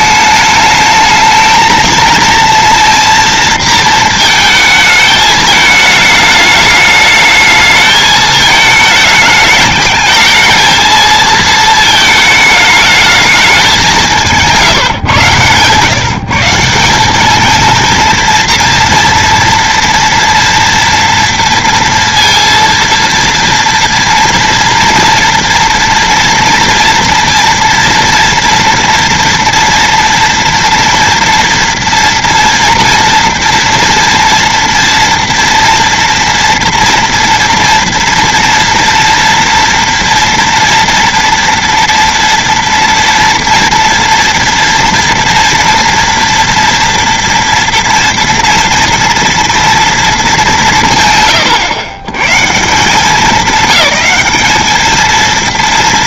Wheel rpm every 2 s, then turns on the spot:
210, 230, 220, 210, 210, 220, 210, 140, 180, 230, 230, 230, 230, 230, 240, 230, 230, 230, 230, 230, 230, 230, 230, 230, 230, 170, 170, 220.
none